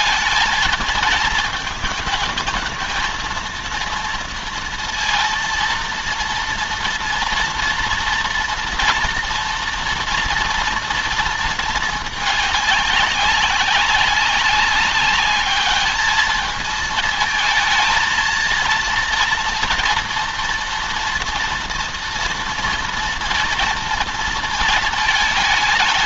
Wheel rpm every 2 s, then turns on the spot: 220, 230, 230, 230, 230, 230, 200, 200, 220, 230, 230, 230, 220.
none